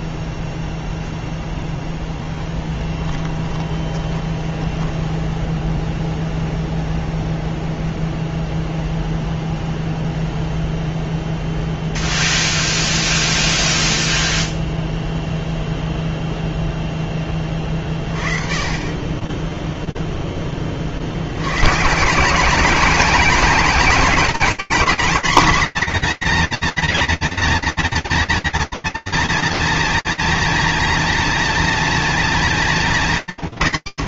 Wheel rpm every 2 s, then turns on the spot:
0, 20, 20, 0, 0, 0, 0, 0, 0, 30, 50, 210, 220, 230, 230, 230, 180.
2-6